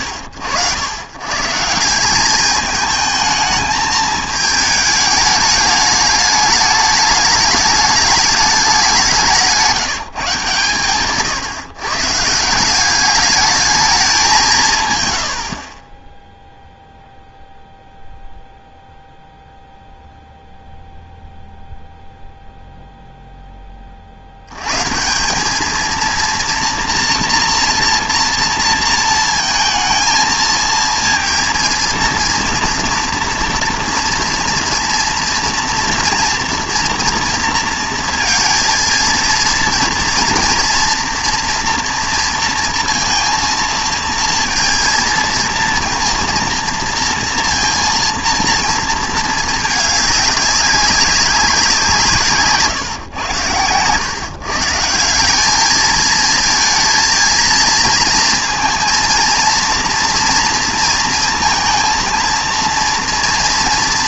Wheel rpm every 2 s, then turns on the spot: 70, 210, 220, 210, 200, 140, 180, 170, 0, 0, 0, 0, 110, 230, 230, 220, 230, 230, 230, 230, 230, 230, 230, 230, 230, 200, 130, 150, 230, 230, 230, 230.
none